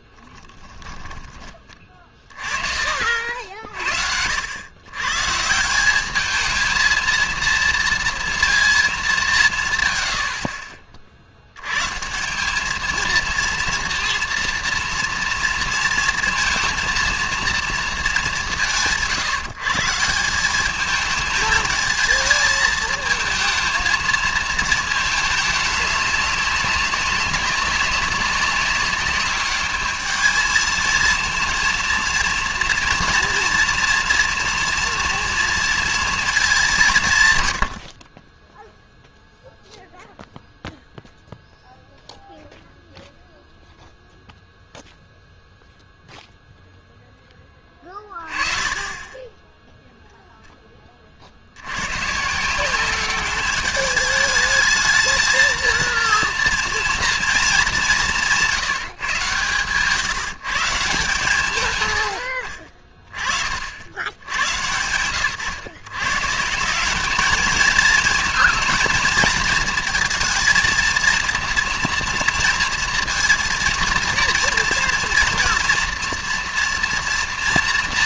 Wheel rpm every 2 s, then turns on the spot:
10, 40, 100, 220, 230, 60, 210, 240, 230, 170, 200, 220, 220, 200, 190, 220, 230, 230, 180, 10, 0, 0, 0, 0, 20, 10, 180, 220, 230, 160, 150, 50, 100, 180, 230, 220, 230, 230, 240.
none